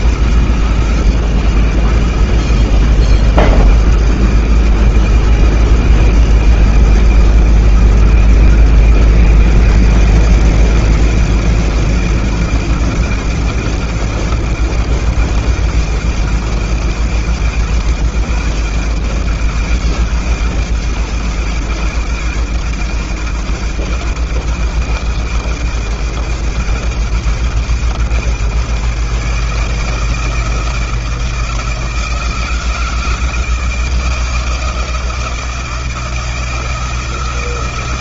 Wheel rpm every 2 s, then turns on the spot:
100, 100, 100, 110, 130, 140, 140, 140, 140, 140, 140, 130, 130, 140, 170, 160, 160, 160, 160.
none